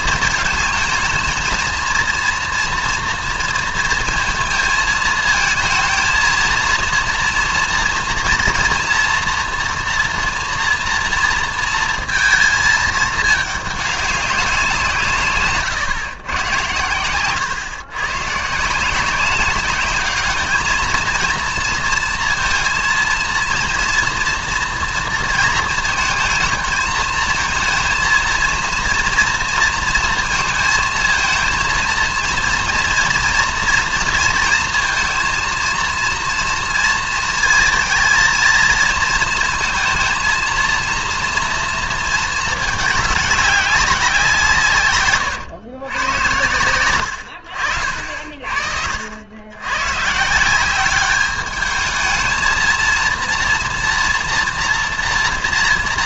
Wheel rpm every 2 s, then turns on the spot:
220, 230, 230, 230, 230, 240, 220, 180, 120, 140, 220, 230, 230, 220, 230, 230, 230, 230, 230, 230, 230, 210, 160, 110, 50, 180, 230, 230.
none